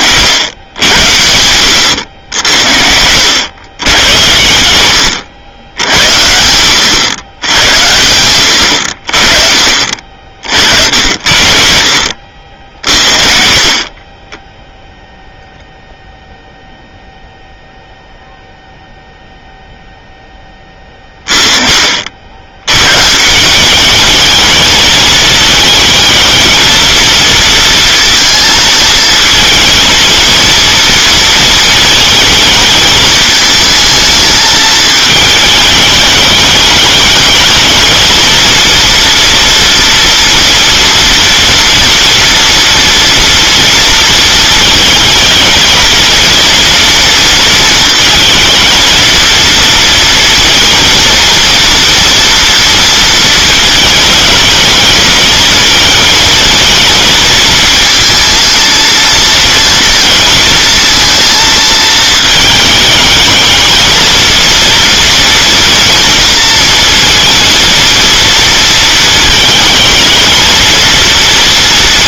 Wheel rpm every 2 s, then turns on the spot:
90, 70, 100, 100, 50, 60, 40, 0, 0, 0, 20, 120, 220, 230, 230, 230, 220, 220, 210, 230, 230, 230, 220, 230, 230, 230, 230, 220, 230, 230, 230, 220, 230, 230, 230, 230.
none